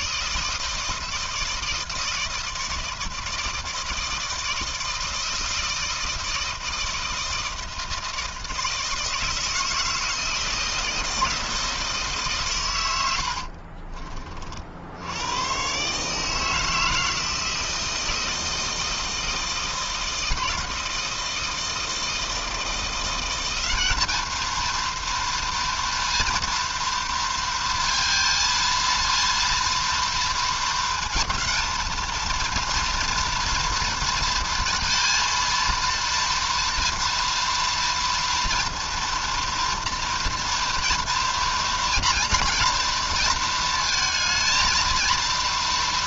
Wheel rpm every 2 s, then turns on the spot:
160, 160, 160, 160, 160, 160, 130, 40, 160, 160, 160, 170, 230, 240, 230, 230, 230, 230, 230, 230, 230, 230, 220.
none